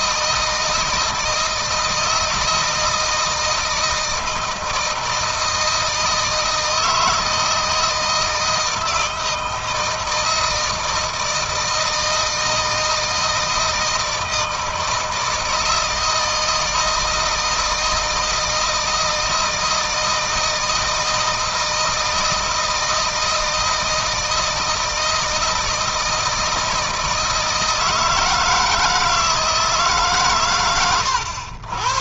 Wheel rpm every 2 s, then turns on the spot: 160, 160, 160, 160, 160, 160, 160, 160, 160, 160, 160, 160, 160, 160, 160, 110.
none